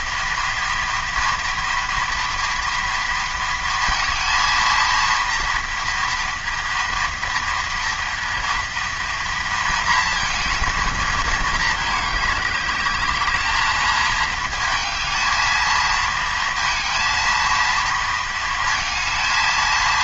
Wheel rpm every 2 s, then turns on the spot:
230, 230, 230, 230, 230, 220, 210, 220, 230, 230.
none